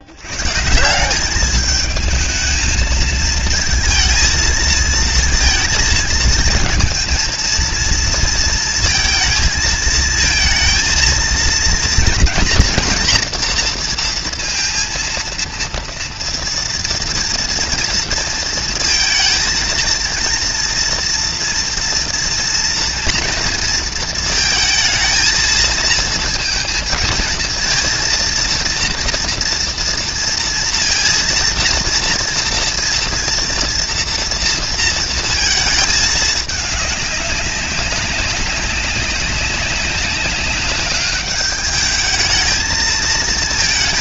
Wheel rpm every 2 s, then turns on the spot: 160, 220, 230, 230, 220, 230, 240, 230, 230, 230, 230, 230, 220, 220, 230, 230, 230, 230, 200, 190, 200, 220.
none